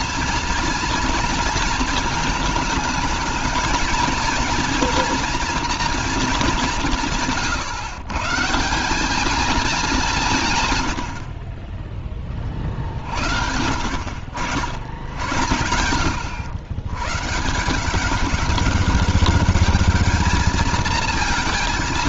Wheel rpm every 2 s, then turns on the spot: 230, 220, 230, 170, 200, 100, 60, 70, 110, 200, 220.
none